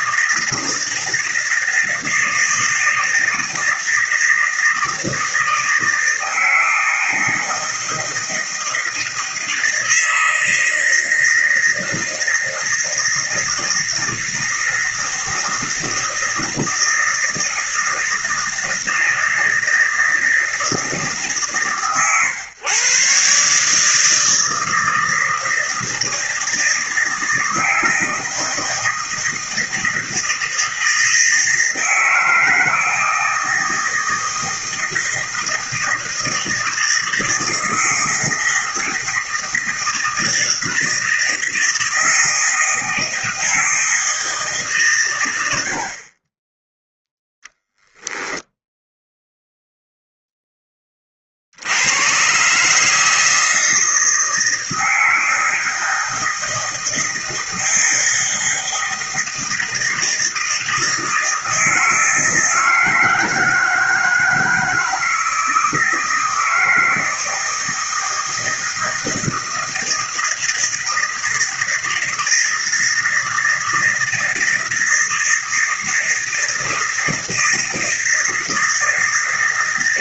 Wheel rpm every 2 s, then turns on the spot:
160, 160, 160, 160, 160, 160, 160, 160, 160, 160, 150, 130, 160, 160, 160, 160, 160, 160, 160, 160, 160, 160, 130, 10, 0, 30, 150, 160, 160, 160, 160, 160, 160, 160, 160, 160, 160, 160, 160, 160.
none